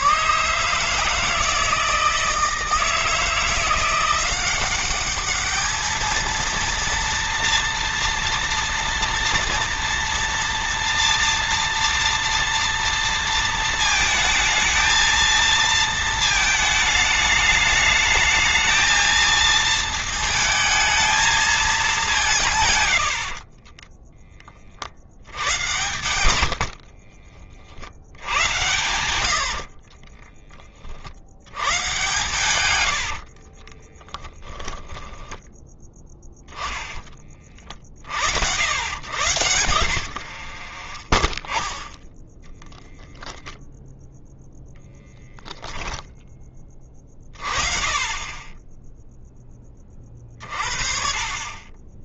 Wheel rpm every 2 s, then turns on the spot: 150, 160, 200, 230, 230, 230, 230, 220, 220, 220, 220, 90, 50, 60, 90, 40, 90, 10, 20, 110, 40, 10, 20, 30, 10, 40.
26-28 32-36 40-42